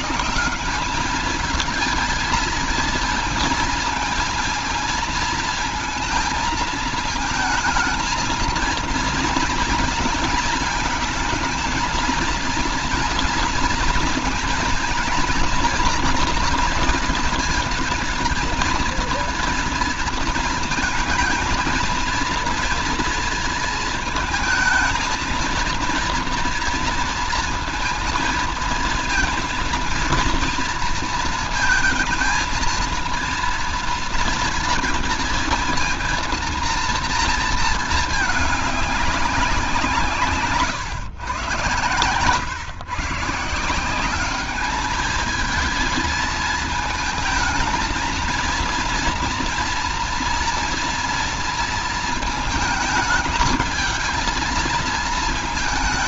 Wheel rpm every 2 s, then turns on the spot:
180, 230, 230, 220, 230, 230, 220, 230, 230, 230, 230, 230, 220, 230, 230, 230, 230, 230, 230, 210, 140, 120, 200, 220, 230, 230, 220, 220.
none